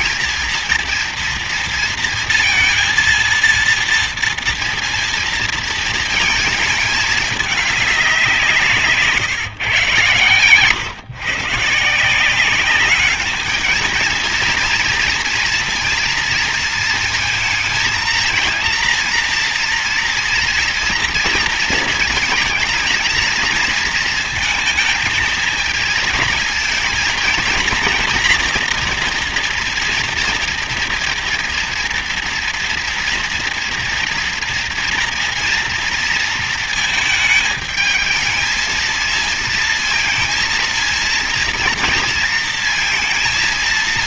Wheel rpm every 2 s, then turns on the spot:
230, 230, 230, 220, 180, 120, 180, 220, 230, 230, 230, 230, 230, 230, 240, 230, 230, 240, 230, 220, 230, 230.
none